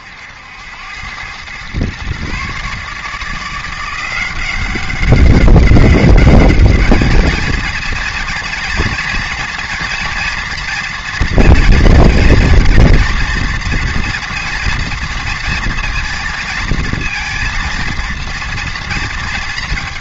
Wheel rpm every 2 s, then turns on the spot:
90, 150, 190, 220, 230, 230, 240, 230, 230, 230.
none